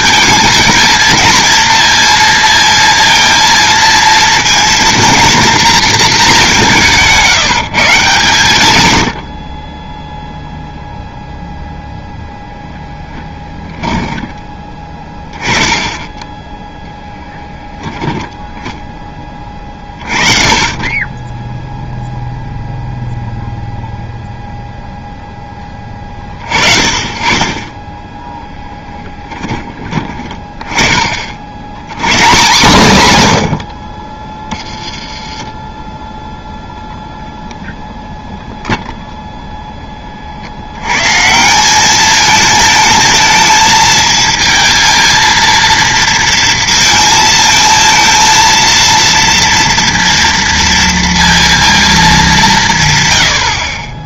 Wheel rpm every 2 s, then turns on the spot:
230, 230, 230, 170, 100, 0, 10, 20, 10, 10, 30, 0, 0, 40, 20, 30, 140, 10, 0, 0, 110, 220, 230, 230, 230, 230, 150.
12-14 28-30